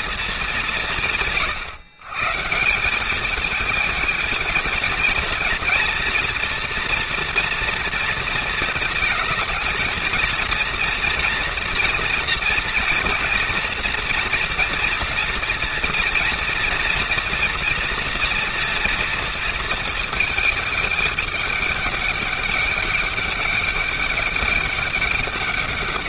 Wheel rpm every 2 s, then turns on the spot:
140, 220, 230, 230, 230, 240, 230, 230, 230, 220, 200, 200, 190.
none